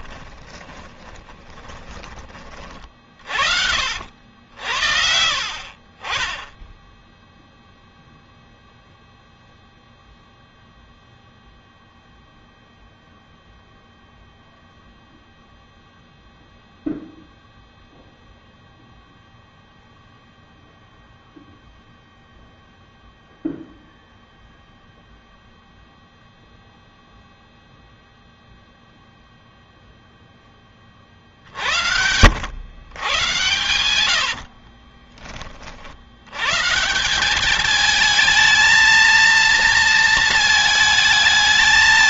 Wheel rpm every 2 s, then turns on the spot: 20, 40, 70, 0, 0, 0, 0, 0, 0, 0, 0, 0, 0, 0, 0, 40, 110, 40, 160, 220, 220.
0-2 4-6 34-36